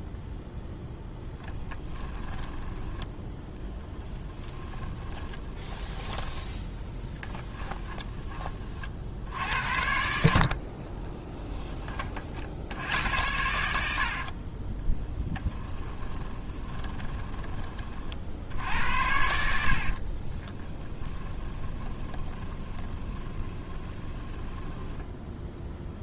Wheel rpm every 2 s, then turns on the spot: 0, 10, 20, 10, 50, 30, 80, 20, 20, 80, 20, 20, 10.
4-8 10-12 14-18 20-26